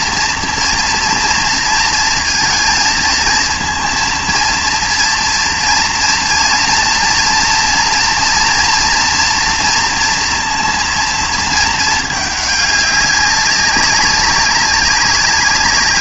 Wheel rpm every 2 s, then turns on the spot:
230, 230, 230, 230, 230, 230, 200, 200.
none